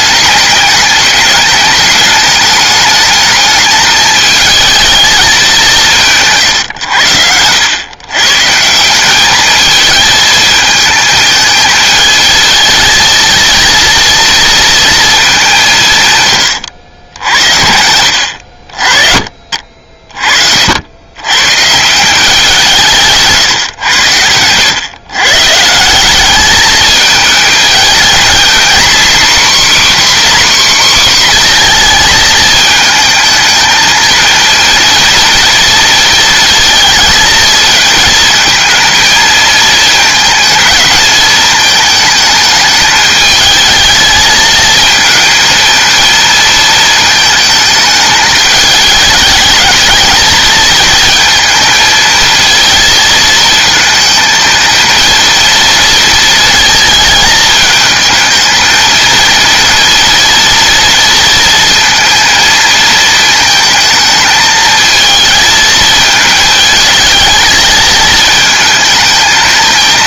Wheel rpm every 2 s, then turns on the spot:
210, 210, 220, 130, 160, 220, 230, 230, 90, 60, 70, 160, 100, 210, 240, 270, 220, 230, 230, 220, 220, 220, 220, 220, 210, 220, 230, 230, 220, 220, 230, 230, 220, 220, 220.
none